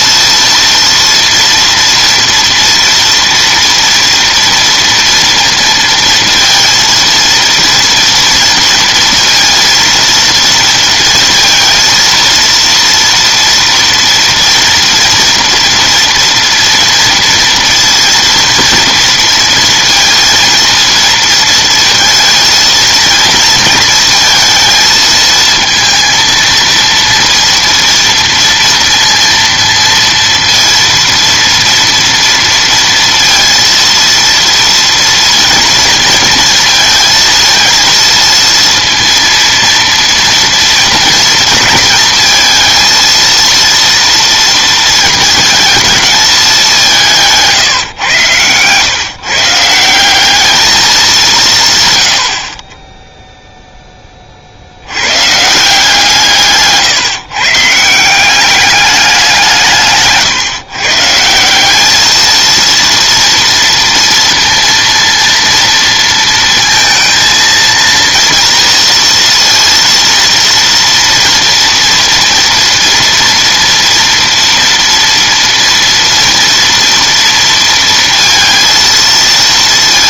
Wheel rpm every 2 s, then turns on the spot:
230, 230, 230, 230, 230, 230, 230, 230, 230, 230, 230, 230, 220, 230, 230, 230, 230, 230, 230, 230, 230, 230, 230, 210, 120, 210, 30, 50, 160, 200, 150, 230, 230, 230, 230, 230, 230, 230, 230, 230.
none